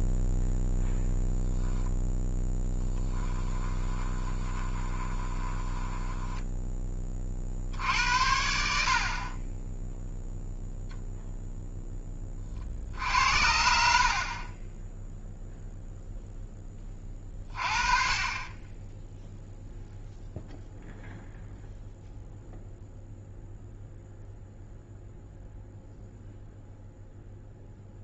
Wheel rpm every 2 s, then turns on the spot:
0, 10, 20, 20, 60, 0, 60, 0, 20, 10, 0, 0, 0, 0.
2-6